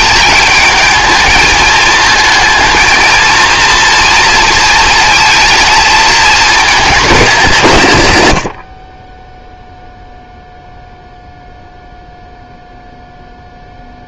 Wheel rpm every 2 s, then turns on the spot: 220, 230, 230, 220, 50, 0, 0.
none